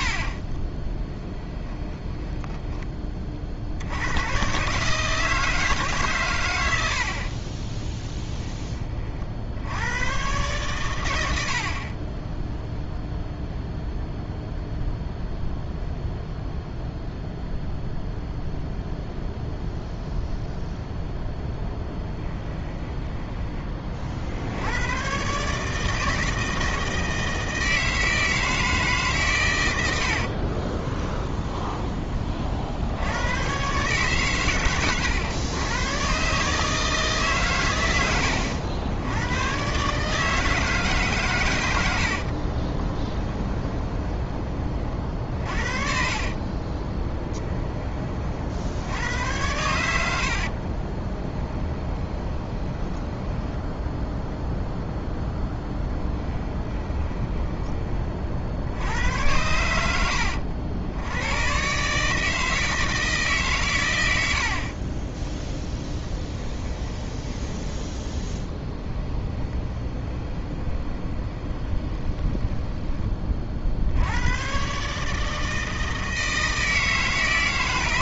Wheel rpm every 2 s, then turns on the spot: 20, 20, 150, 80, 30, 110, 0, 0, 0, 0, 0, 10, 110, 160, 150, 20, 80, 110, 160, 90, 140, 20, 30, 20, 80, 20, 10, 0, 20, 80, 80, 160, 40, 20, 10, 20, 20, 140, 160.
0-2 22-24 30-32 42-44 46-48 50-54 56-58 64-72